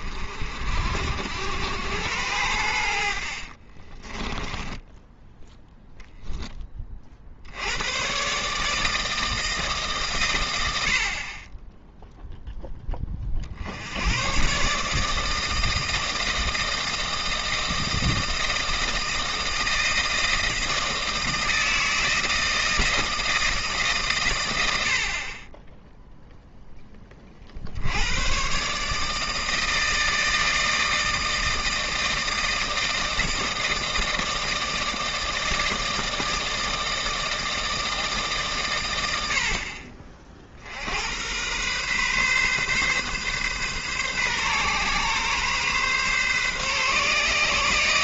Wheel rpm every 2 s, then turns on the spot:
60, 80, 10, 20, 150, 90, 10, 140, 160, 160, 160, 170, 80, 10, 140, 160, 160, 160, 160, 120, 60, 130, 130, 140.
4-6